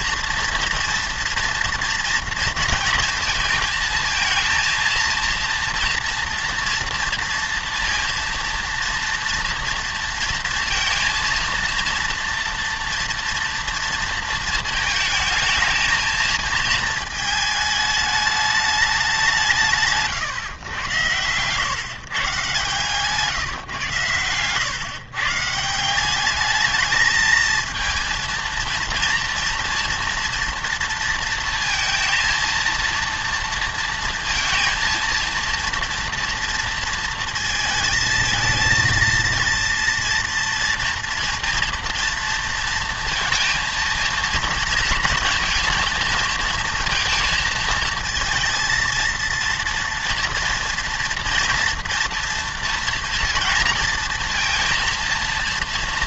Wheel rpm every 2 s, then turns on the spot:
230, 230, 230, 230, 230, 230, 230, 220, 220, 210, 110, 140, 120, 210, 230, 230, 230, 230, 230, 230, 230, 230, 230, 230, 230, 230, 230, 230.
none